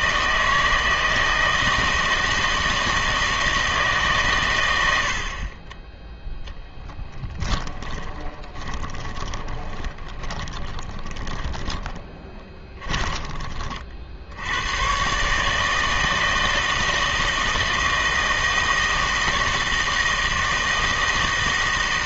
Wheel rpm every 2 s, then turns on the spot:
160, 160, 100, 10, 20, 20, 20, 100, 160, 160, 160.
6-14